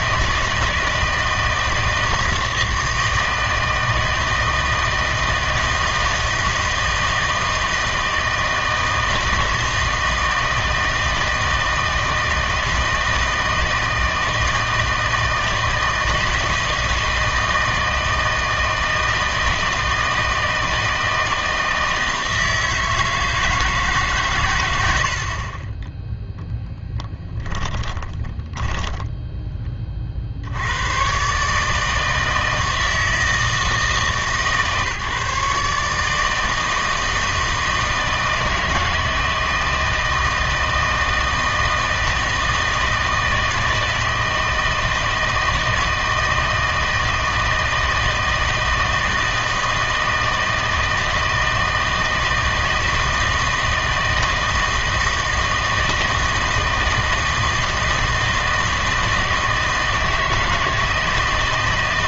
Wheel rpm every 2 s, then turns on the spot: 160, 160, 160, 160, 160, 160, 160, 160, 160, 160, 160, 160, 100, 0, 10, 90, 160, 150, 160, 160, 160, 160, 160, 160, 160, 160, 160, 160, 160, 160, 160.
28-30